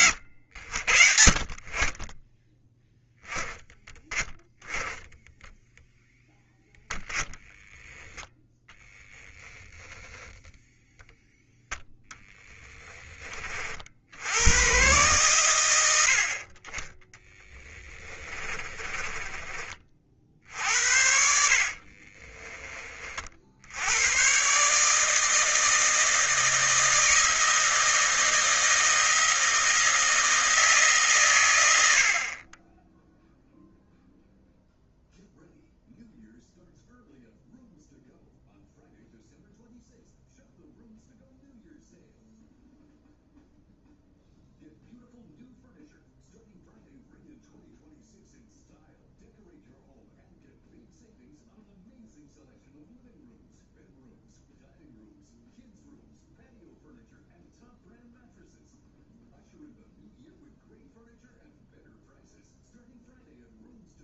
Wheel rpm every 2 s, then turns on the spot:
60, 10, 10, 10, 10, 0, 10, 120, 20, 20, 60, 30, 150, 160, 160, 140, 10, 0, 0, 0, 0, 0, 0, 0, 0, 0, 0, 0, 0, 0, 0, 0.
18-20